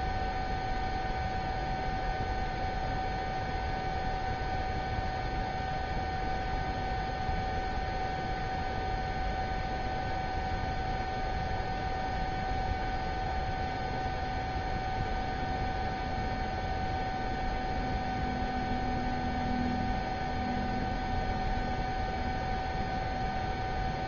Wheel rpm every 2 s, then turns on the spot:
0, 0, 0, 0, 0, 0, 0, 0, 0, 0, 0, 0.
none